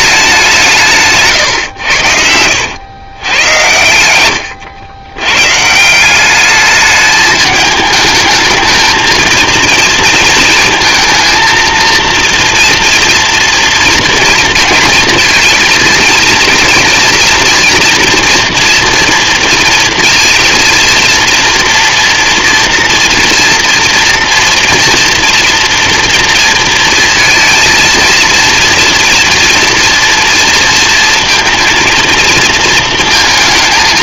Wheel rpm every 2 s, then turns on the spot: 180, 90, 110, 210, 220, 230, 230, 230, 230, 240, 230, 230, 230, 230, 230, 230, 220.
none